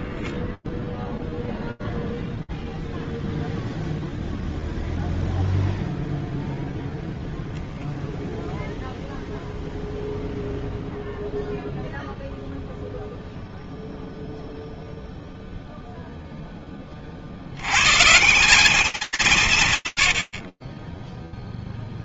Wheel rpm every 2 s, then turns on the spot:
0, 0, 0, 0, 0, 0, 0, 0, 130, 120, 0.
none